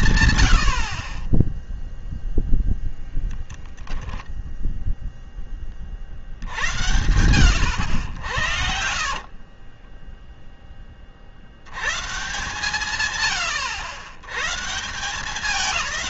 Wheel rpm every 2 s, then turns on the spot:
80, 0, 0, 80, 70, 10, 140, 150.
none